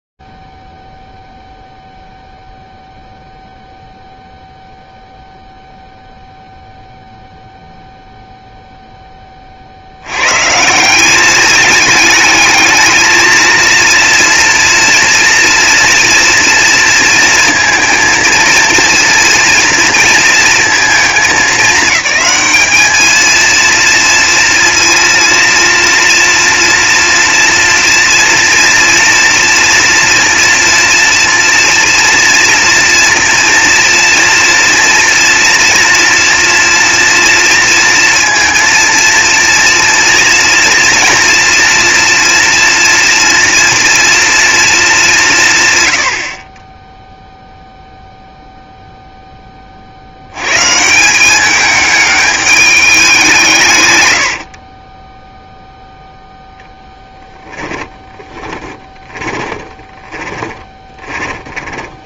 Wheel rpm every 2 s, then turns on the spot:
0, 0, 0, 0, 0, 140, 220, 230, 230, 230, 230, 210, 230, 230, 230, 230, 230, 230, 240, 230, 230, 230, 230, 40, 0, 110, 210, 90, 0, 30, 20.
54-56 58-62